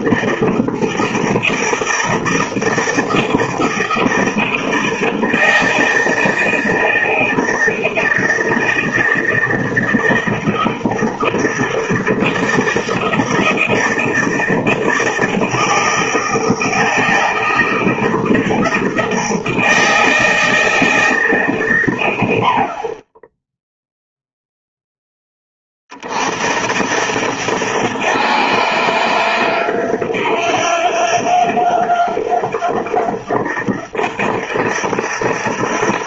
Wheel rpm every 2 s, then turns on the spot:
160, 160, 160, 160, 160, 160, 160, 160, 160, 160, 160, 60, 0, 60, 90, 90, 90, 90.
none